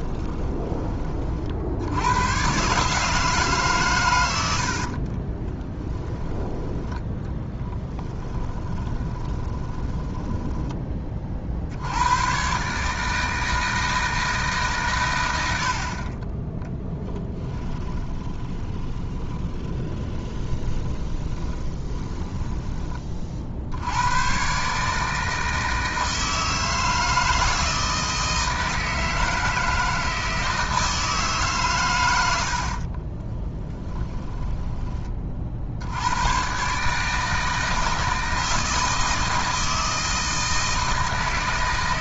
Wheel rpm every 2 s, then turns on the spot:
20, 140, 50, 10, 20, 20, 140, 140, 10, 20, 20, 10, 140, 160, 160, 160, 50, 20, 140, 160, 160.
4-6 8-10 16-22 32-34